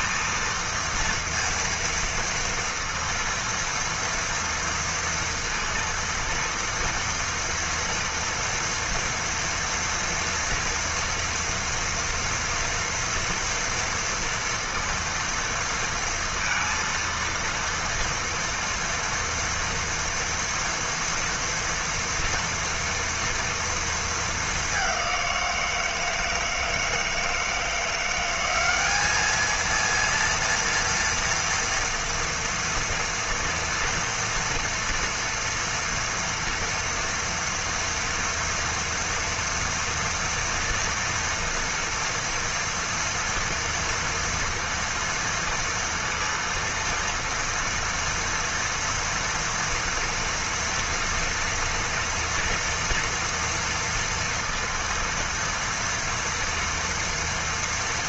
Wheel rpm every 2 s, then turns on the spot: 230, 230, 230, 230, 230, 230, 230, 230, 230, 230, 230, 230, 200, 160, 200, 230, 230, 230, 230, 230, 230, 230, 230, 230, 230, 230, 240, 230, 230.
none